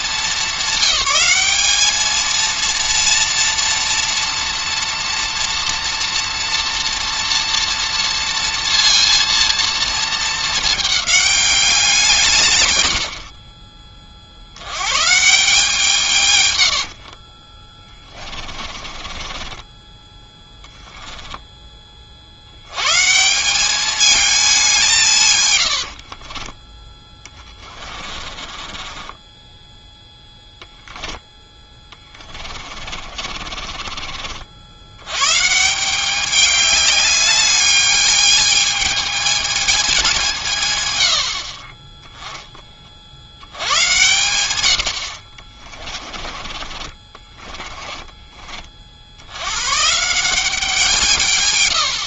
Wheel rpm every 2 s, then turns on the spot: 190, 230, 240, 230, 230, 220, 130, 80, 110, 30, 10, 90, 200, 20, 30, 0, 30, 70, 200, 210, 160, 20, 100, 30, 30, 180.
18-20 26-30 32-34 46-48